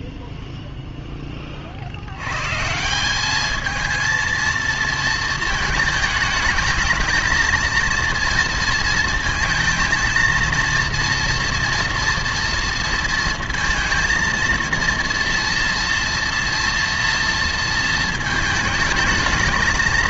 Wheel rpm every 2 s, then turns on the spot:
0, 150, 230, 220, 230, 230, 230, 230, 230, 220.
none